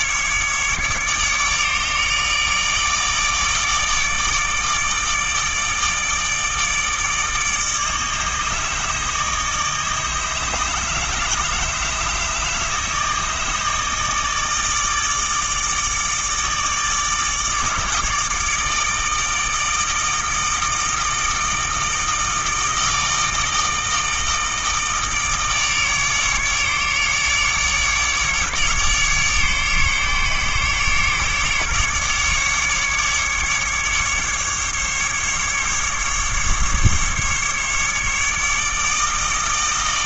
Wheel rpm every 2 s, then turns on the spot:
150, 150, 150, 160, 150, 150, 150, 150, 150, 160, 160, 160, 160, 150, 150, 140, 140, 150, 150, 150.
none